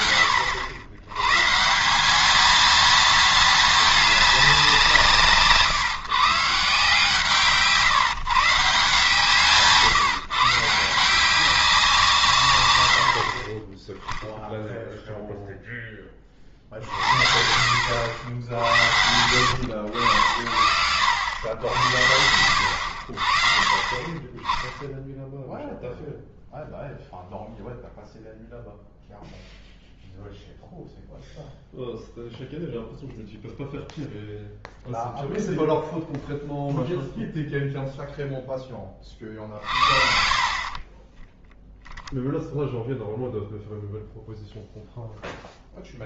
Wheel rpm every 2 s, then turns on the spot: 80, 220, 190, 150, 160, 160, 120, 0, 50, 70, 70, 80, 10, 0, 0, 0, 0, 0, 0, 10, 50, 0, 0.
22-24